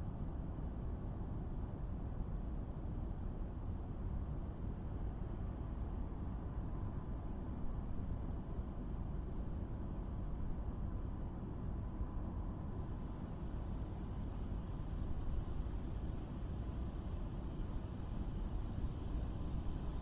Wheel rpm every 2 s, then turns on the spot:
0, 0, 0, 0, 0, 0, 0, 0, 0, 0.
none